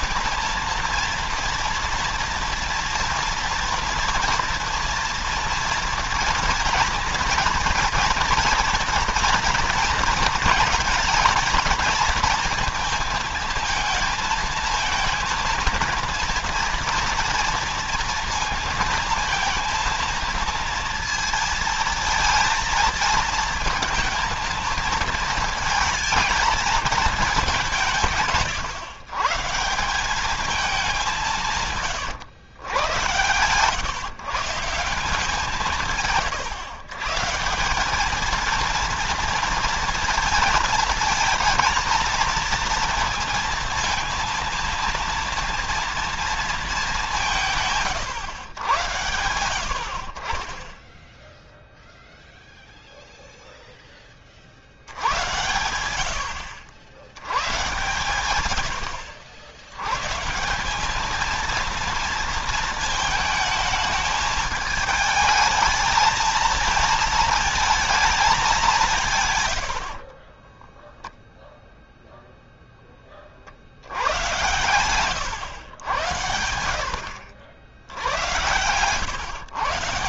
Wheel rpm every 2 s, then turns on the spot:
230, 230, 230, 230, 230, 230, 230, 220, 230, 230, 230, 230, 230, 220, 130, 200, 100, 160, 130, 230, 230, 230, 230, 210, 90, 10, 0, 60, 70, 100, 180, 220, 210, 220, 200, 20, 0, 110, 70, 90.
70-72 74-76